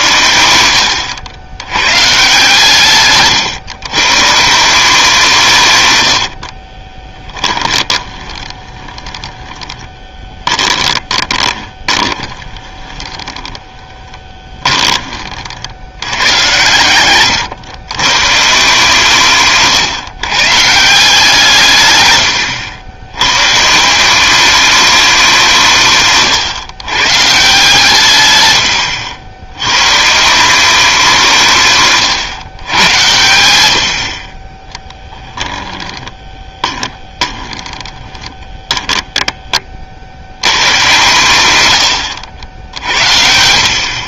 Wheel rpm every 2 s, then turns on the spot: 90, 150, 170, 40, 20, 20, 20, 20, 100, 150, 160, 90, 200, 120, 100, 190, 110, 10, 20, 10, 130, 60.
6-16 34-40